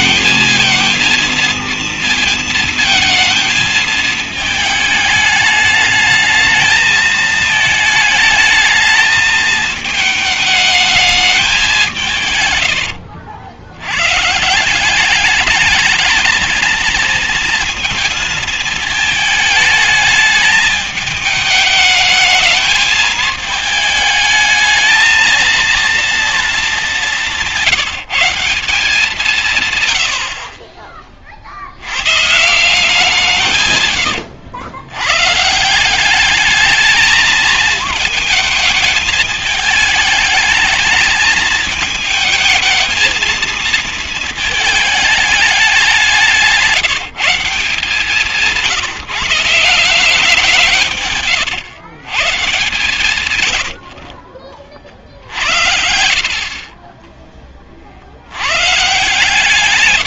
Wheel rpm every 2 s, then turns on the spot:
220, 220, 210, 220, 220, 210, 100, 160, 230, 220, 210, 220, 220, 220, 190, 50, 170, 110, 210, 220, 220, 220, 220, 180, 180, 170, 140, 50, 30, 110.
none